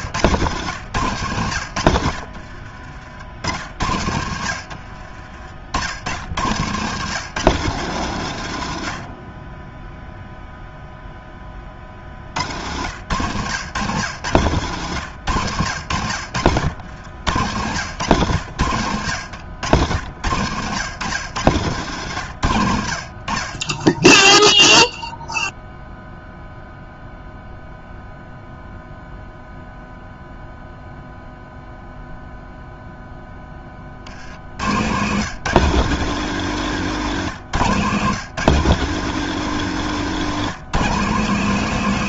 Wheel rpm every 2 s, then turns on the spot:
120, 50, 60, 110, 120, 0, 90, 110, 80, 110, 110, 80, 0, 0, 0, 0, 0, 80, 170, 160, 170.
2-6 16-20